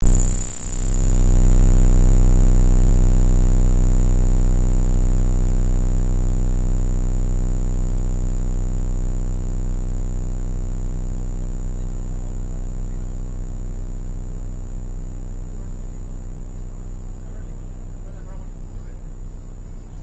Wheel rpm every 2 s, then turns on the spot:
0, 0, 0, 0, 0, 0, 0, 0, 0, 0.
none